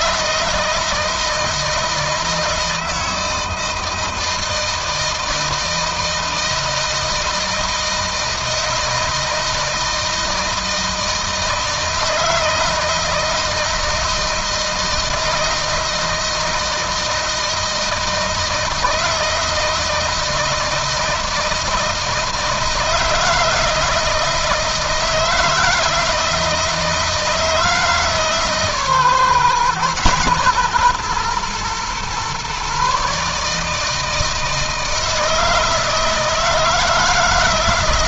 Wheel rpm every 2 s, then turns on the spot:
160, 160, 160, 160, 160, 160, 160, 160, 160, 160, 160, 160, 160, 160, 140, 120, 140, 160, 160.
none